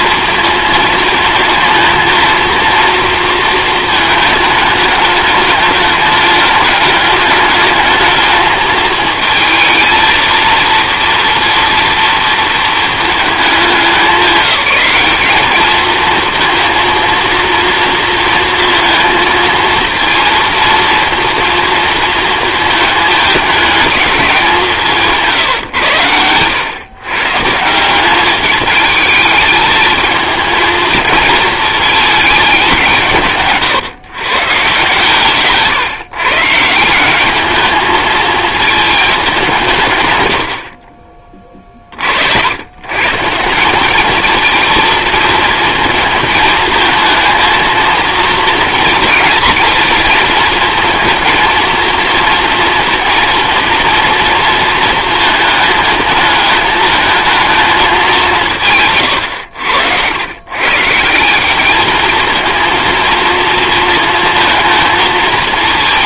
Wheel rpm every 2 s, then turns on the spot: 220, 230, 210, 210, 220, 230, 230, 200, 230, 230, 230, 220, 170, 110, 210, 220, 190, 130, 170, 220, 50, 110, 230, 220, 230, 230, 230, 230, 220, 150, 140, 230, 230.
none